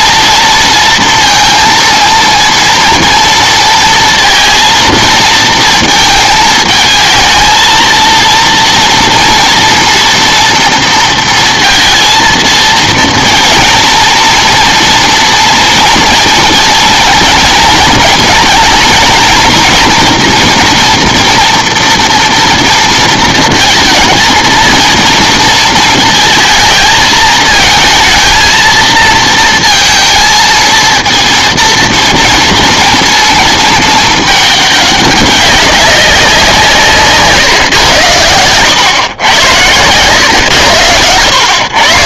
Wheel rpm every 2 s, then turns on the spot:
230, 230, 230, 220, 230, 230, 230, 230, 240, 230, 230, 230, 230, 220, 230, 230, 230, 210, 170, 120, 110.
none